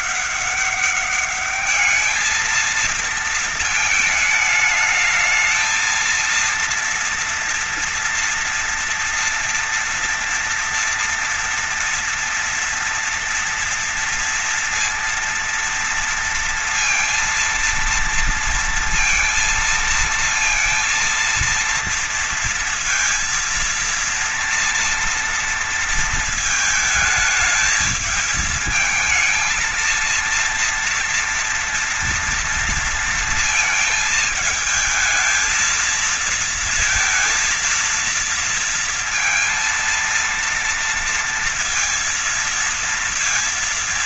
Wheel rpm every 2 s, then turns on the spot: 200, 220, 220, 230, 230, 230, 230, 230, 230, 230, 230, 230, 230, 220, 220, 230, 230, 220, 220, 230, 230, 230.
none